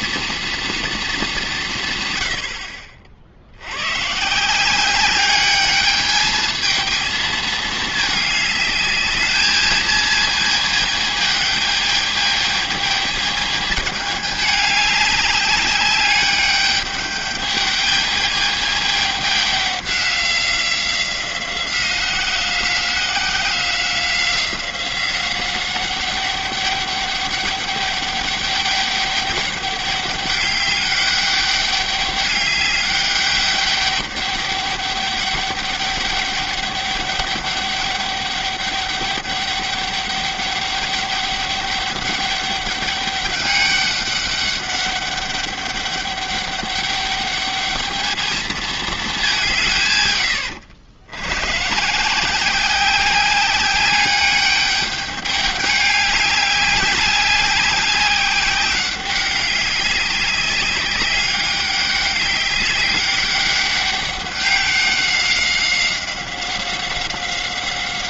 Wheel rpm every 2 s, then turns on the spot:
230, 60, 180, 220, 210, 220, 220, 200, 210, 210, 190, 180, 180, 200, 200, 200, 200, 200, 200, 200, 200, 200, 200, 210, 220, 80, 190, 210, 200, 190, 200, 200, 190, 190.
none